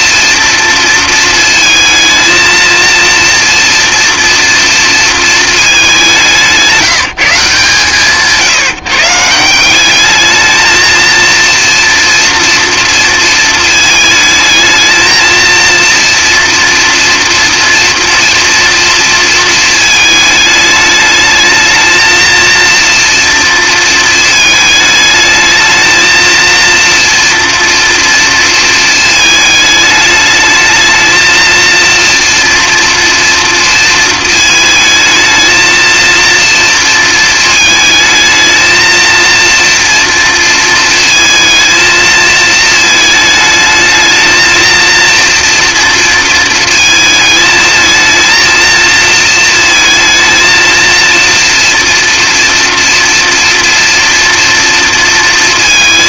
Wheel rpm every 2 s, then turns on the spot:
230, 230, 230, 160, 160, 220, 230, 220, 240, 230, 220, 230, 220, 230, 230, 220, 230, 220, 230, 220, 230, 220, 230, 220, 230, 230, 230, 230.
none